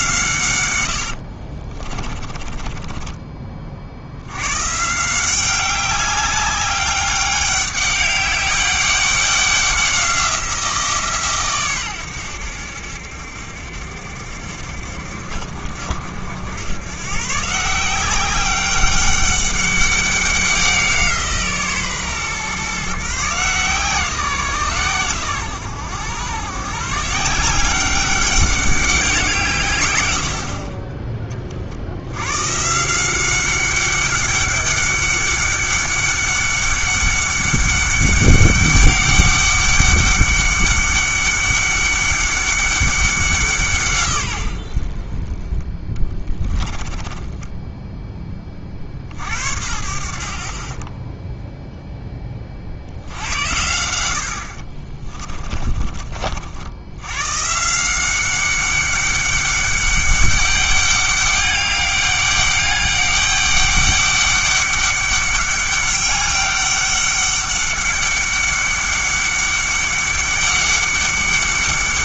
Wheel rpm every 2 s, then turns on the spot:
100, 20, 150, 200, 200, 170, 80, 60, 110, 200, 180, 140, 130, 140, 190, 30, 160, 200, 200, 200, 200, 200, 60, 30, 50, 20, 60, 40, 90, 200, 200, 200, 200, 200, 200, 190.
0-4 46-48 54-56